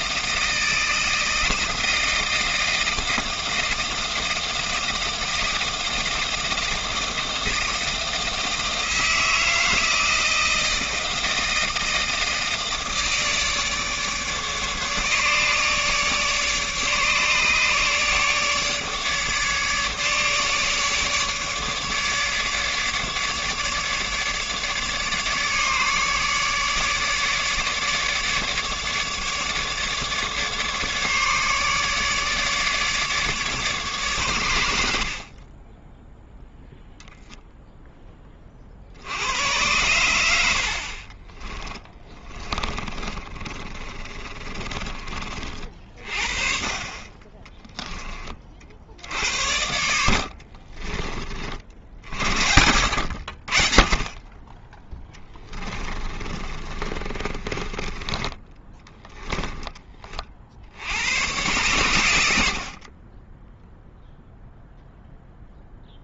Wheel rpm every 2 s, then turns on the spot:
160, 160, 160, 160, 160, 160, 160, 150, 150, 150, 150, 150, 150, 150, 150, 150, 150, 90, 0, 40, 60, 20, 30, 40, 40, 40, 70, 10, 30, 10, 60, 60, 0.
42-46 50-52 56-60